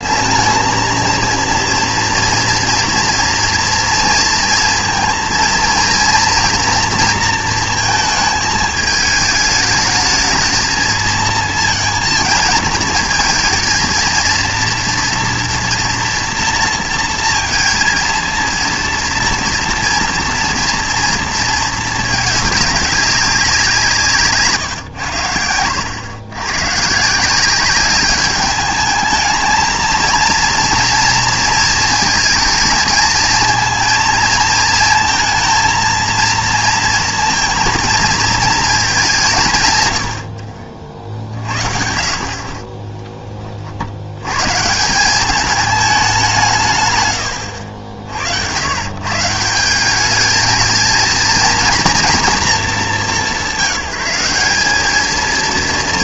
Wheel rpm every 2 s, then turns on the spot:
230, 230, 230, 230, 210, 220, 220, 230, 230, 230, 230, 200, 130, 130, 210, 230, 220, 230, 230, 210, 50, 20, 160, 150, 110, 220, 200, 210.
42-44